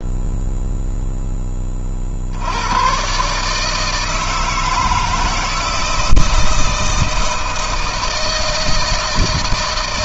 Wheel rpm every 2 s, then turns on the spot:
10, 130, 160, 160, 160.
none